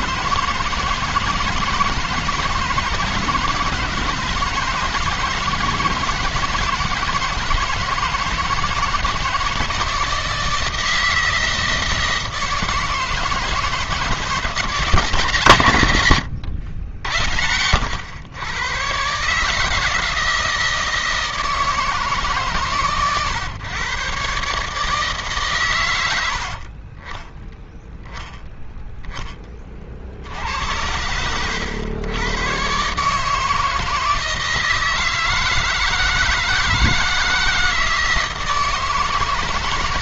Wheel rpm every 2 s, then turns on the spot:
160, 170, 160, 170, 160, 160, 160, 170, 100, 120, 160, 150, 140, 70, 10, 80, 130, 160, 160, 160.
none